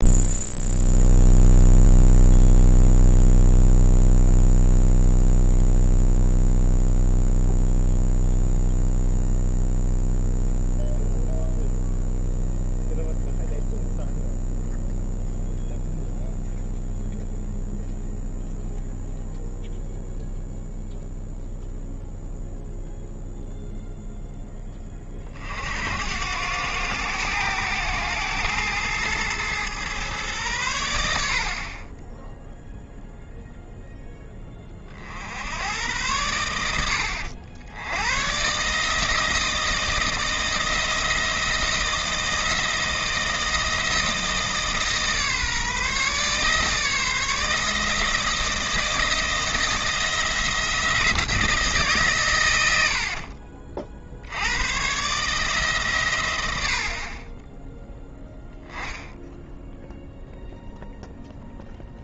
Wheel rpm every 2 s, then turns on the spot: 0, 0, 0, 0, 0, 0, 0, 0, 0, 0, 0, 0, 10, 100, 110, 110, 0, 30, 90, 140, 170, 160, 160, 150, 170, 170, 100, 100, 90, 10, 0.
none